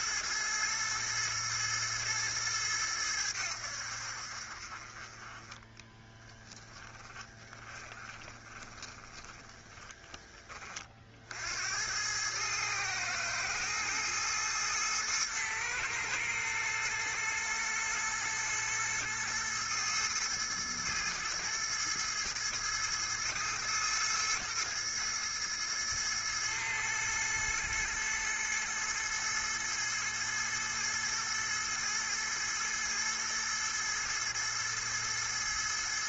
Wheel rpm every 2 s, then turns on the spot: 110, 100, 30, 20, 20, 50, 110, 110, 110, 110, 110, 110, 110, 110, 110, 110, 110, 110.
6-10